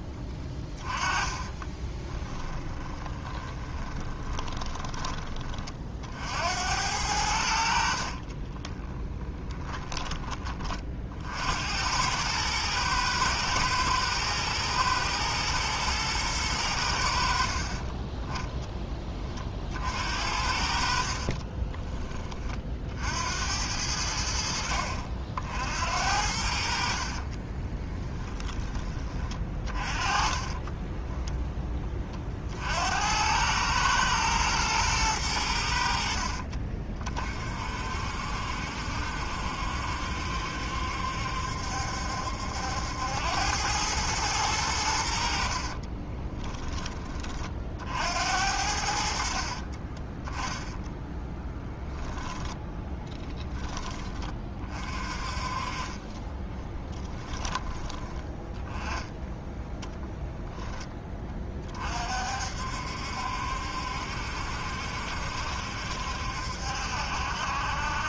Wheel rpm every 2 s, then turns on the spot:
20, 20, 20, 80, 40, 40, 110, 110, 80, 10, 60, 60, 60, 60, 20, 20, 70, 110, 50, 60, 70, 80, 90, 20, 70, 10, 10, 40, 10, 20, 10, 60, 70, 70.
0-6 8-10 20-22 30-32 50-54 56-58